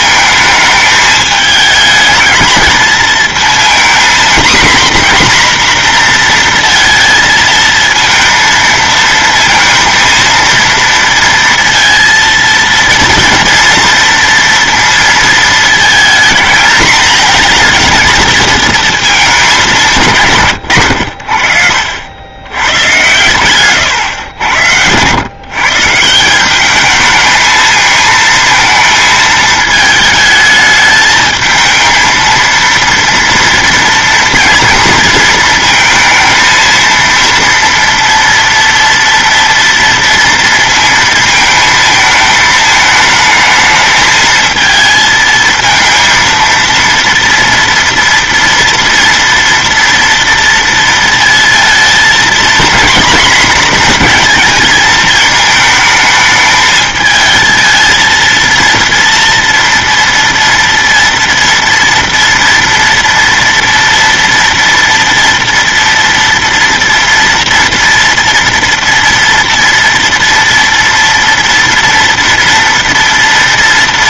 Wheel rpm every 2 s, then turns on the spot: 220, 220, 250, 230, 230, 230, 230, 230, 220, 220, 120, 110, 100, 210, 220, 220, 230, 230, 230, 230, 230, 220, 220, 230, 230, 230, 240, 220, 220, 230, 230, 230, 230, 230, 230, 230, 230.
24-26